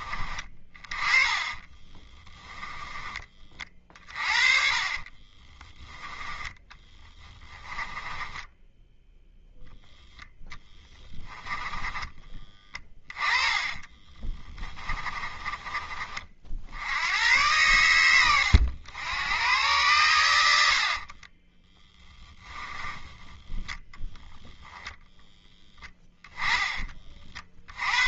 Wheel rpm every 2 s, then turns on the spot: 30, 10, 30, 10, 10, 10, 20, 20, 80, 90, 70, 10, 0, 30.
2-16 20-24